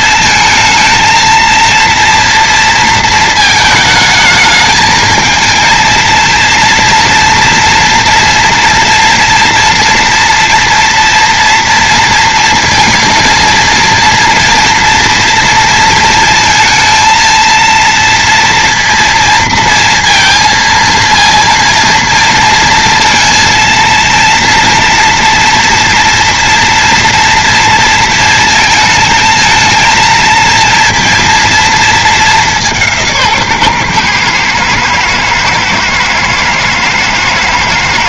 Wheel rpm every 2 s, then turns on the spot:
220, 230, 220, 230, 230, 230, 230, 230, 230, 230, 230, 230, 230, 230, 220, 230, 180, 110, 110.
none